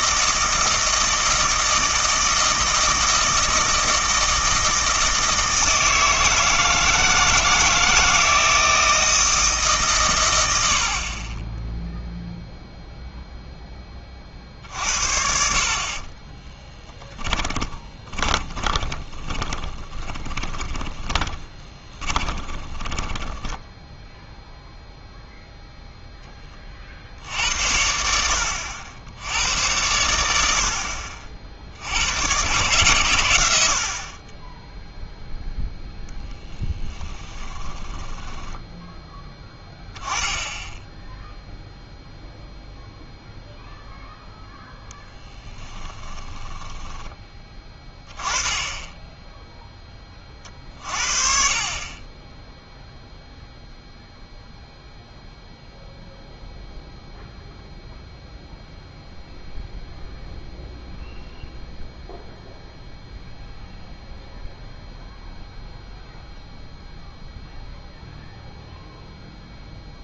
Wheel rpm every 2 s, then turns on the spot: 160, 160, 160, 160, 160, 70, 0, 60, 10, 20, 20, 20, 0, 40, 70, 70, 120, 0, 10, 10, 10, 0, 0, 10, 10, 40, 0, 0, 0, 0, 0, 0, 0, 0, 0.
16-24 36-40 46-48